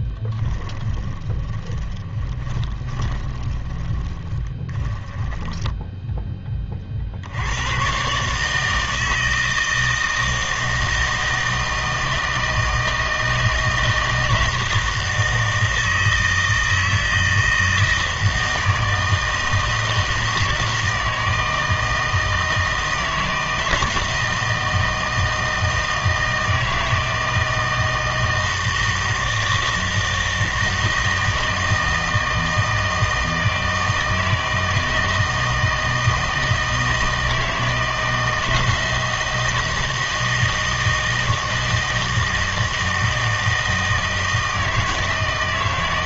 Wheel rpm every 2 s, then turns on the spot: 10, 20, 20, 30, 160, 160, 160, 160, 160, 160, 160, 160, 160, 160, 160, 160, 160, 160, 160, 160, 160, 160, 160.
0-6